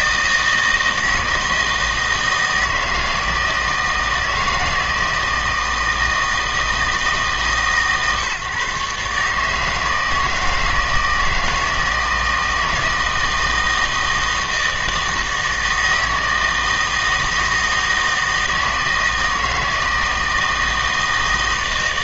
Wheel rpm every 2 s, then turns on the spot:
160, 160, 160, 160, 140, 160, 160, 160, 160, 160, 160.
none